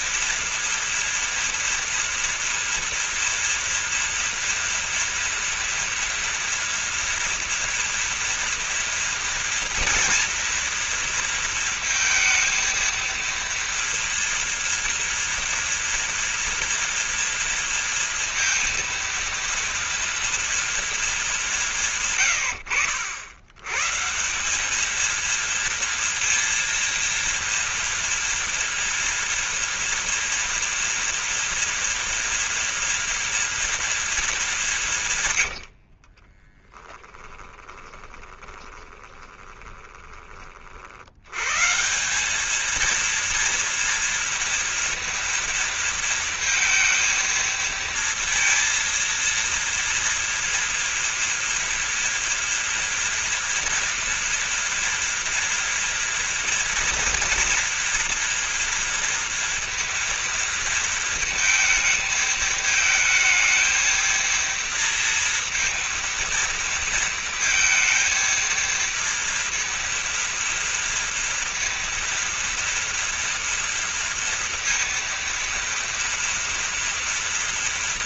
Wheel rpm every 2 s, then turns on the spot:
230, 230, 230, 230, 230, 240, 230, 230, 230, 230, 230, 110, 190, 230, 230, 230, 230, 190, 20, 20, 40, 210, 230, 220, 230, 230, 230, 230, 230, 230, 230, 220, 230, 230, 230, 230, 230, 230, 230.
36-40